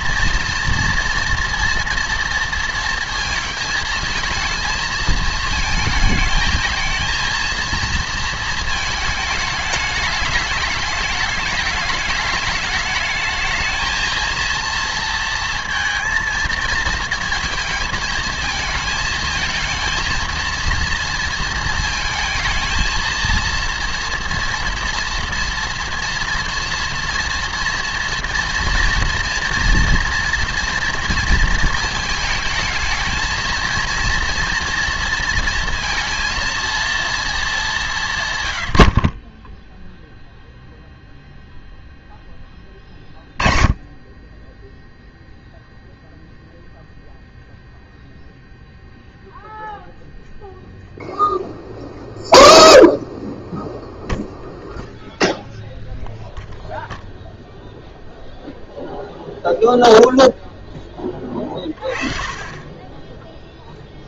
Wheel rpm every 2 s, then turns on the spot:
230, 230, 230, 220, 220, 210, 210, 230, 230, 220, 230, 230, 240, 240, 240, 230, 220, 240, 230, 80, 0, 20, 10, 0, 0, 0, 0, 0, 0, 0, 10, 20.
none